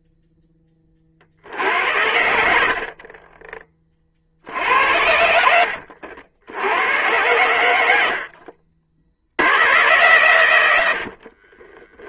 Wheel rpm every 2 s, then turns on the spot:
10, 60, 70, 80, 60, 100.
4-6 10-12